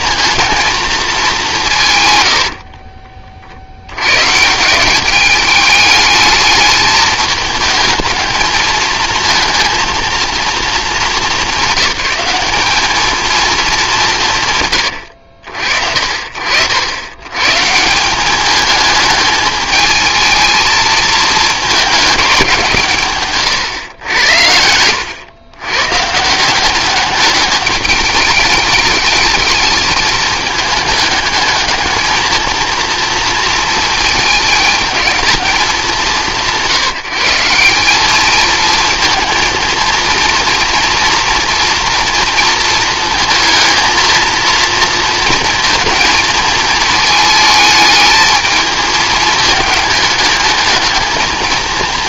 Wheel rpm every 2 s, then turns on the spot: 220, 40, 170, 210, 220, 220, 210, 120, 80, 210, 220, 160, 100, 190, 210, 210, 230, 220, 160, 220, 230, 230, 230, 220, 220, 220.
2-4